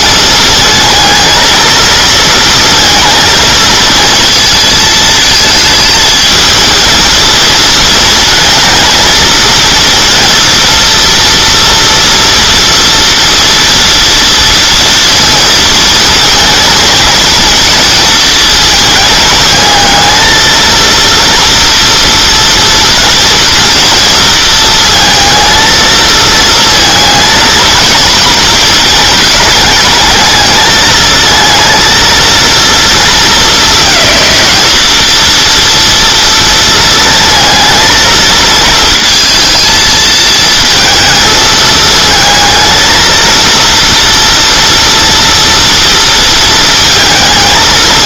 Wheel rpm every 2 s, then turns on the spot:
220, 230, 230, 220, 230, 230, 230, 230, 230, 220, 230, 230, 230, 230, 220, 220, 230, 220, 230, 230, 220, 230, 230, 230.
none